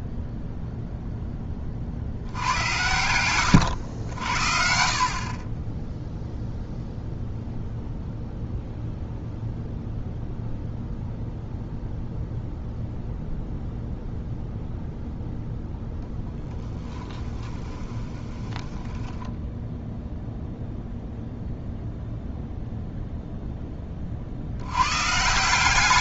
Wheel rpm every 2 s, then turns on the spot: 0, 90, 50, 0, 0, 0, 0, 0, 10, 10, 0, 0, 90.
16-20